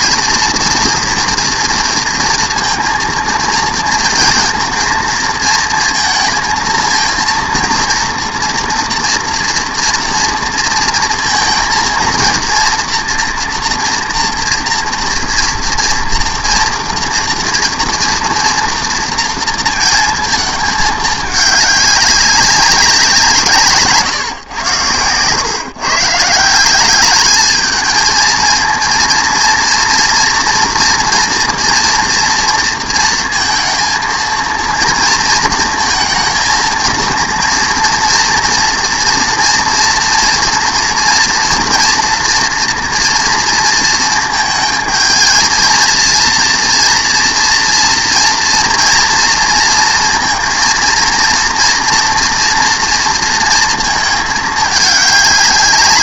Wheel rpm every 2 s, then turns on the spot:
230, 230, 230, 230, 230, 230, 230, 230, 240, 230, 220, 200, 110, 170, 230, 230, 230, 230, 230, 230, 240, 240, 220, 230, 230, 230, 230, 210.
none